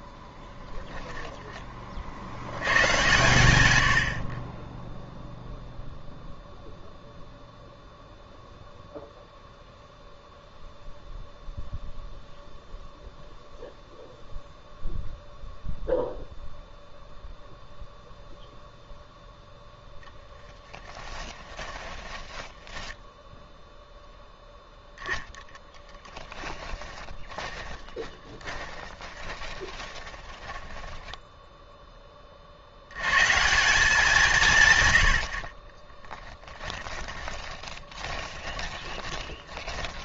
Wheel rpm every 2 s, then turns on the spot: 10, 110, 10, 0, 0, 0, 0, 0, 0, 0, 10, 10, 0, 20, 20, 10, 90, 120, 10, 20.
0-2 20-22 26-32 36-40